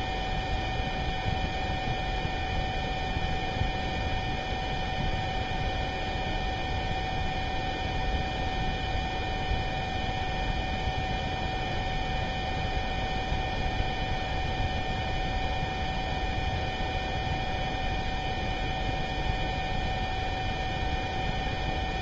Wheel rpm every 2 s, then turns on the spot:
0, 0, 0, 0, 0, 0, 0, 0, 0, 0, 0.
none